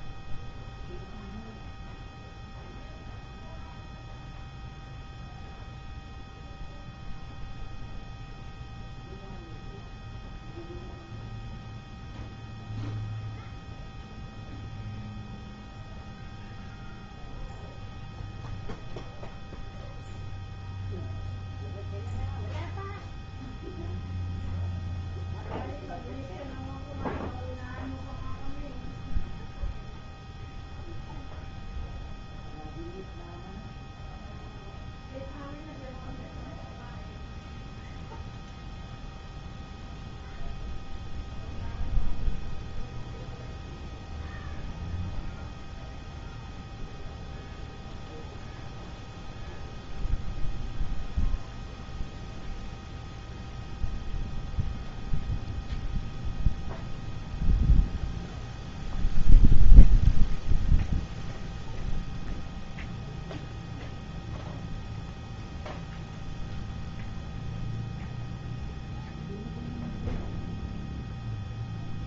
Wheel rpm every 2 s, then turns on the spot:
0, 0, 0, 0, 0, 0, 0, 0, 0, 0, 0, 0, 0, 0, 0, 0, 0, 0, 0, 0, 0, 0, 0, 0, 0, 0, 0, 0, 0, 0, 0, 0, 0, 0, 0, 0.
none